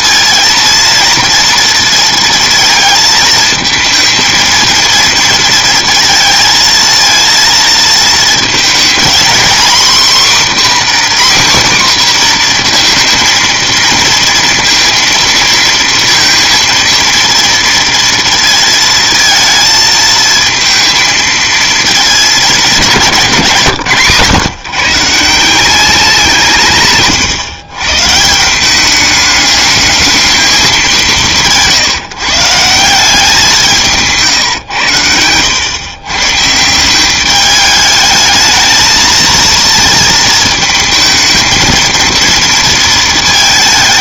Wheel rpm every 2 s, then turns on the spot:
230, 230, 230, 230, 230, 280, 240, 230, 230, 230, 230, 190, 140, 140, 190, 210, 170, 130, 170, 220, 220, 230.
none